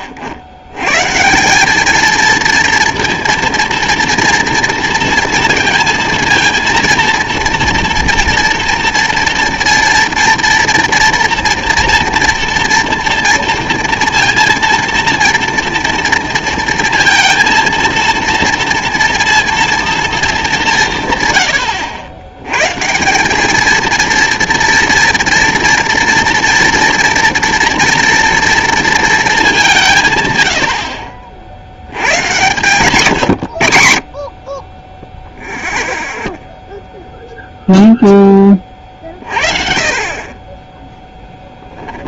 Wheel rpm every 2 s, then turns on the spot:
90, 230, 230, 230, 240, 240, 230, 230, 230, 230, 210, 110, 230, 230, 230, 110, 120, 40, 0, 20, 20.
none